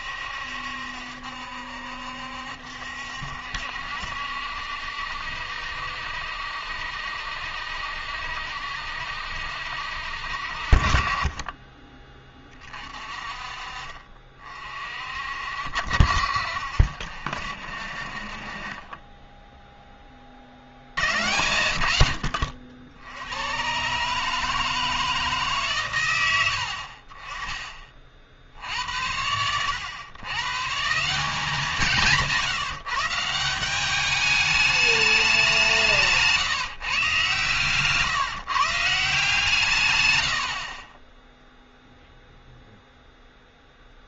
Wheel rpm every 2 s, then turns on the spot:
70, 70, 70, 70, 70, 50, 30, 40, 60, 40, 60, 70, 160, 80, 70, 150, 160, 210, 140, 150, 50, 0.
18-20 40-42